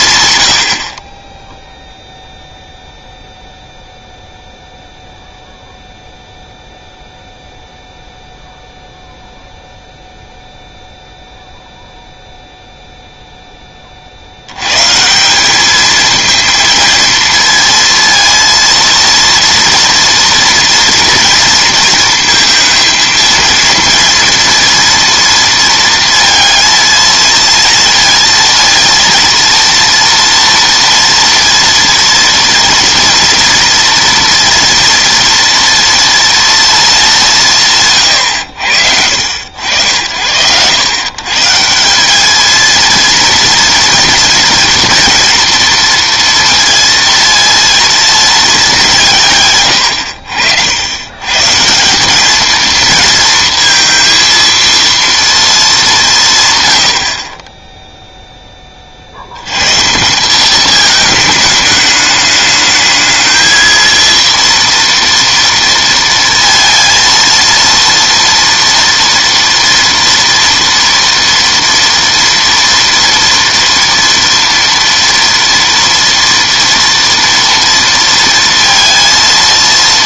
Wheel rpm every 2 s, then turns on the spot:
90, 0, 0, 0, 0, 0, 0, 100, 230, 230, 230, 220, 230, 230, 230, 230, 230, 230, 230, 90, 90, 220, 230, 230, 210, 80, 220, 230, 120, 20, 200, 210, 230, 230, 230, 230, 230, 230, 230, 230.
none